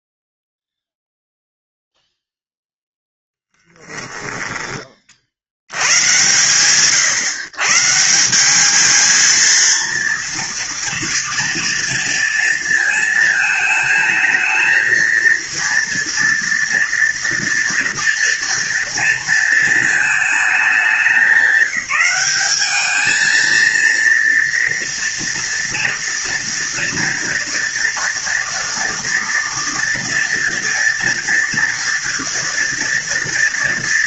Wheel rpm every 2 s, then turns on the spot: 0, 0, 10, 130, 190, 230, 230, 230, 230, 230, 220, 210, 240, 230, 230, 230, 230.
none